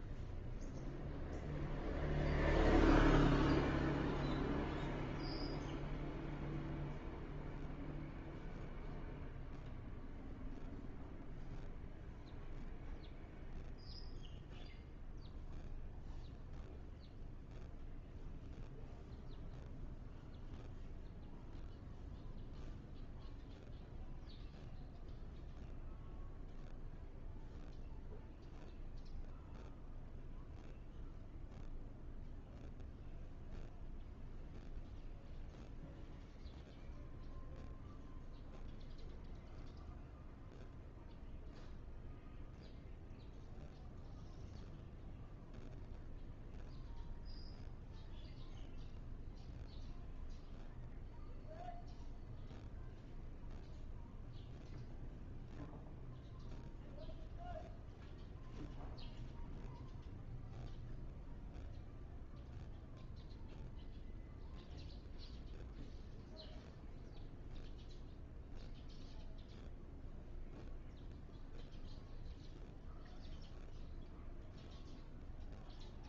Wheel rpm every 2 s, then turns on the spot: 0, 0, 0, 0, 0, 0, 0, 0, 0, 0, 0, 0, 0, 0, 0, 0, 0, 0, 0, 0, 0, 0, 0, 0, 0, 0, 0, 0, 0, 0, 0, 0, 0, 0, 0, 0, 0, 0.
none